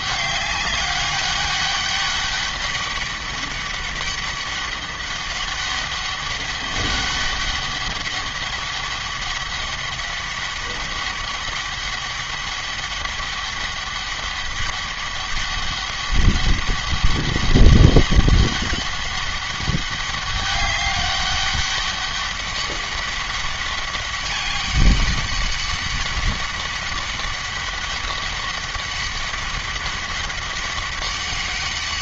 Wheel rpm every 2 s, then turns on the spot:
200, 200, 200, 200, 200, 200, 200, 200, 200, 200, 200, 200, 200, 200, 200, 200.
none